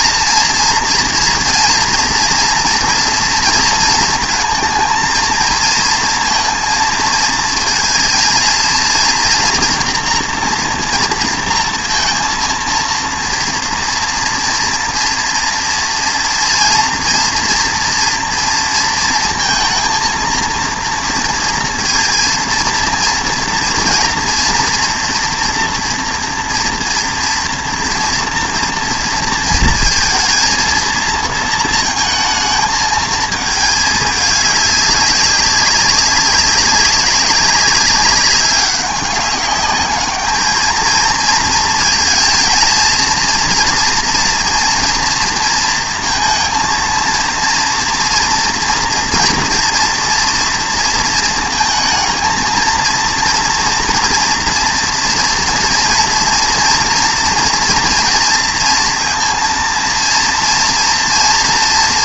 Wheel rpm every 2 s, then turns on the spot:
230, 230, 220, 230, 230, 230, 230, 230, 230, 230, 230, 230, 240, 230, 230, 230, 220, 200, 190, 200, 220, 230, 230, 230, 240, 230, 230, 230, 230, 230, 230.
none